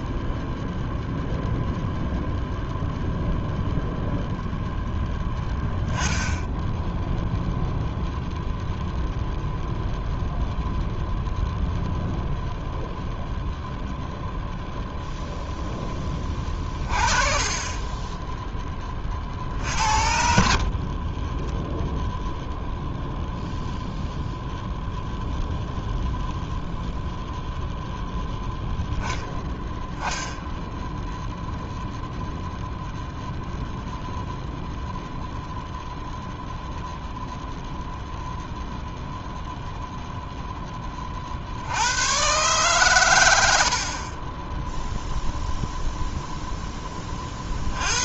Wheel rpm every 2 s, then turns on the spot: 0, 0, 0, 0, 0, 0, 0, 0, 30, 20, 40, 0, 0, 0, 0, 0, 0, 0, 0, 0, 20, 120, 0, 10.
20-22